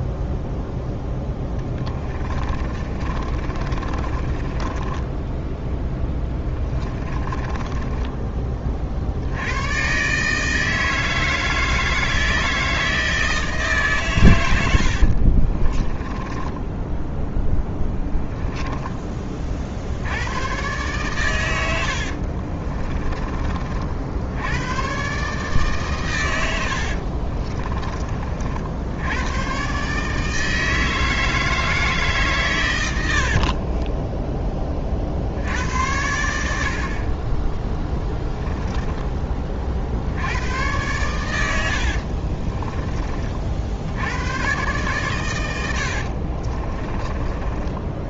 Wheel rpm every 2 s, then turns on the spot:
0, 30, 20, 20, 40, 160, 160, 80, 10, 10, 130, 30, 120, 70, 70, 160, 100, 30, 60, 10, 100, 20, 120, 30.
2-8 14-18 22-24 26-28 38-40 46-48